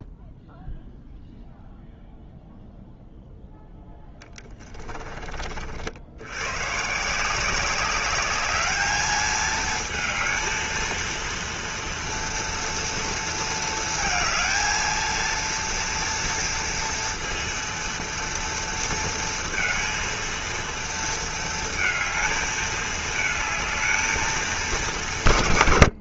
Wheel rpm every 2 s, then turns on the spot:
0, 0, 20, 130, 220, 230, 230, 220, 230, 230, 230, 220, 180.
4-6